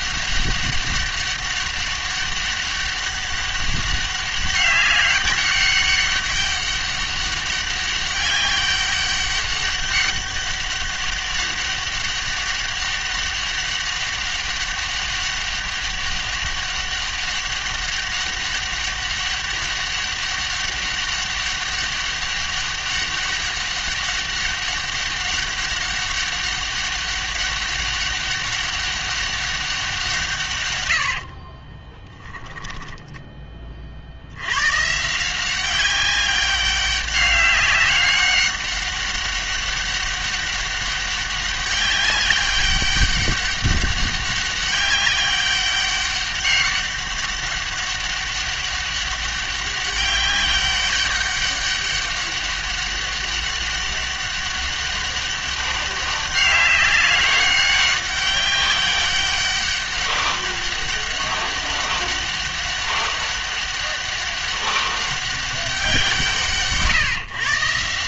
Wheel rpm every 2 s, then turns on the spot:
200, 200, 200, 200, 200, 200, 200, 200, 200, 200, 200, 200, 200, 200, 200, 120, 10, 110, 200, 200, 200, 200, 200, 200, 200, 200, 200, 200, 200, 200, 200, 200, 200, 150.
32-34